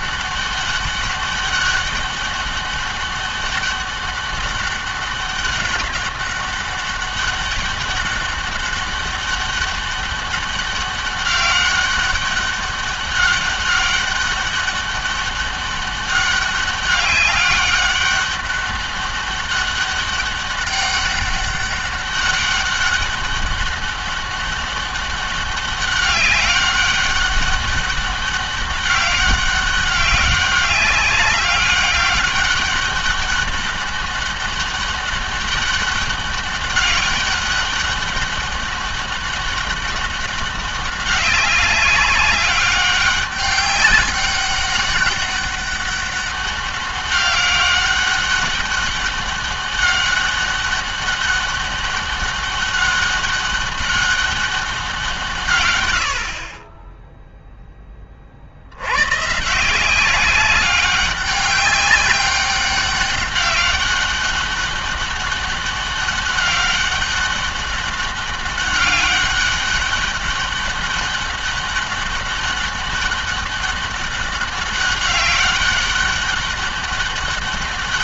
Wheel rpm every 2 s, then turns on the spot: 200, 200, 200, 200, 200, 200, 200, 200, 200, 200, 200, 200, 200, 200, 200, 190, 200, 200, 200, 200, 200, 200, 200, 200, 200, 200, 200, 180, 20, 90, 200, 200, 200, 200, 200, 200, 200, 200, 200.
none